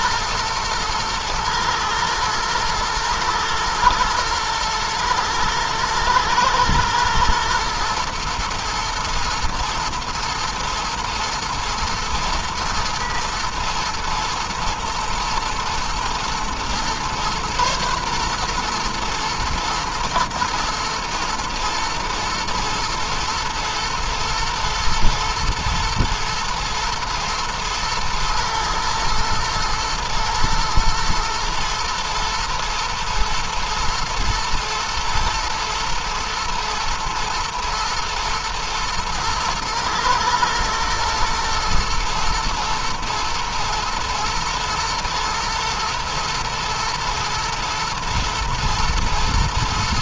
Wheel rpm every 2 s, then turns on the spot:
120, 110, 110, 110, 120, 120, 120, 110, 120, 120, 110, 110, 110, 120, 110, 120, 110, 110, 110, 110, 120, 120, 120, 110, 120.
none